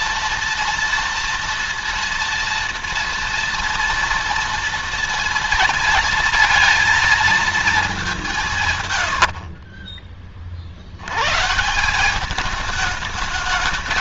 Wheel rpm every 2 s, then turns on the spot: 240, 230, 230, 230, 150, 50, 210.
8-10